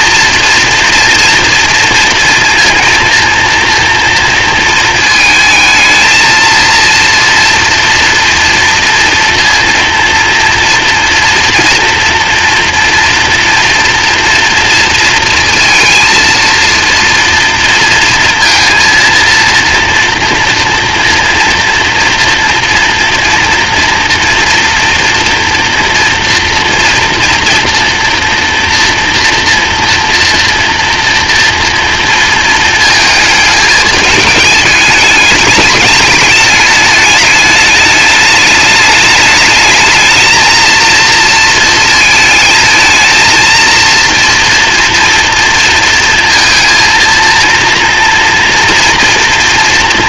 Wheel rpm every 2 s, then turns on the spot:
230, 230, 230, 230, 230, 230, 230, 230, 230, 230, 230, 240, 230, 230, 230, 230, 220, 210, 210, 210, 220, 220, 240, 230, 230.
none